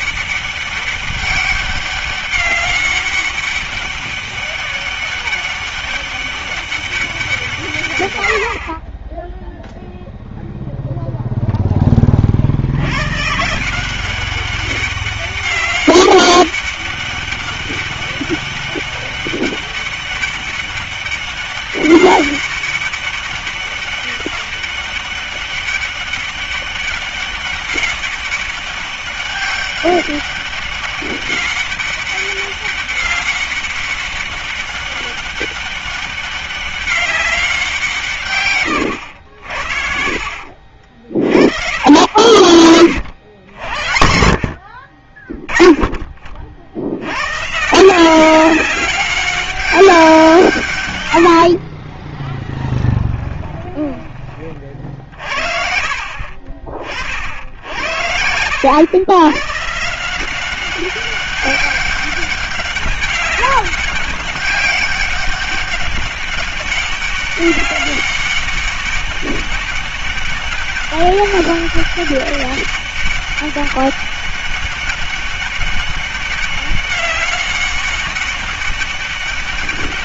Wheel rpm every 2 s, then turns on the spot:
200, 200, 200, 200, 60, 0, 70, 200, 200, 200, 200, 200, 200, 200, 200, 200, 200, 200, 200, 100, 50, 50, 40, 60, 190, 130, 10, 40, 40, 100, 190, 190, 190, 200, 200, 200, 200, 200, 200, 200.
52-54